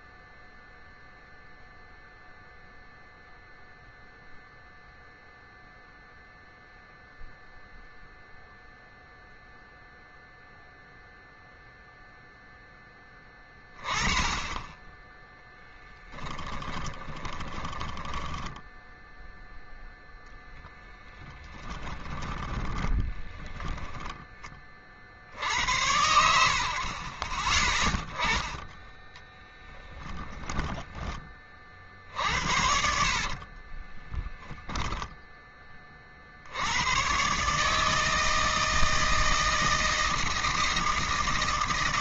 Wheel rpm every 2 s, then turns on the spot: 0, 0, 0, 0, 0, 0, 0, 20, 20, 10, 0, 20, 20, 80, 10, 10, 60, 0, 70, 160, 160.
16-20 22-24 30-34